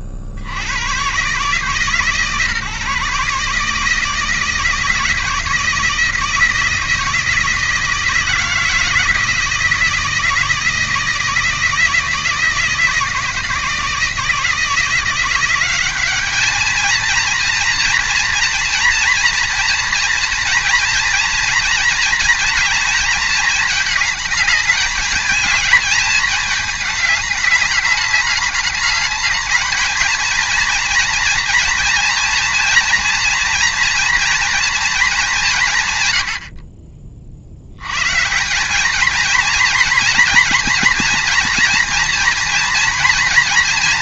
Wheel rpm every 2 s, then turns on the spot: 80, 140, 160, 160, 160, 160, 160, 170, 220, 230, 230, 220, 210, 220, 210, 230, 230, 230, 50, 190, 230, 230.
none